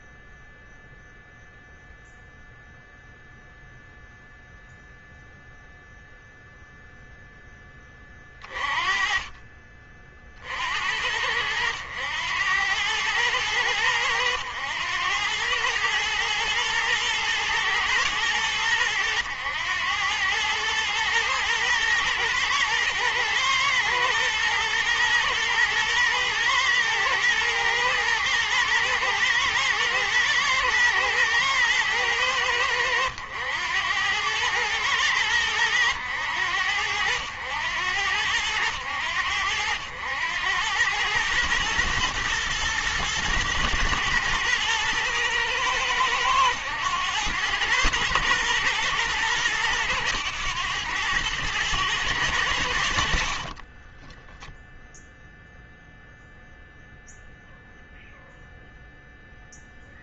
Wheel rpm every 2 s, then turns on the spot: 0, 0, 0, 0, 30, 60, 100, 100, 110, 100, 110, 110, 120, 110, 120, 110, 100, 100, 90, 90, 90, 110, 110, 100, 120, 110, 80, 0, 0, 0.
none